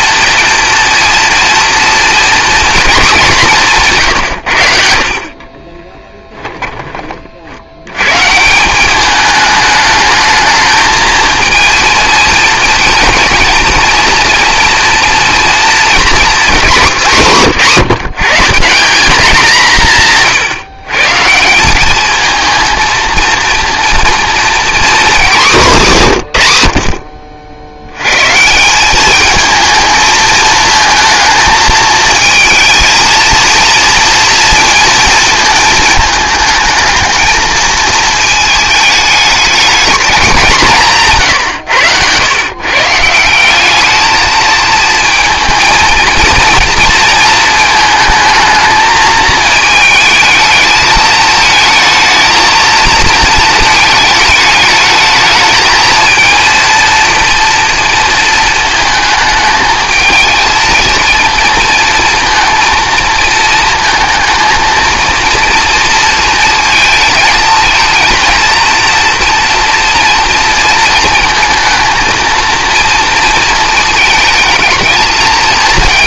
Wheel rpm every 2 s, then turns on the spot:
230, 230, 90, 10, 160, 220, 220, 230, 220, 180, 130, 230, 240, 100, 170, 220, 220, 230, 210, 220, 190, 130, 220, 230, 220, 220, 230, 220, 230, 220, 230, 230, 230, 230, 230, 230, 230, 220.
none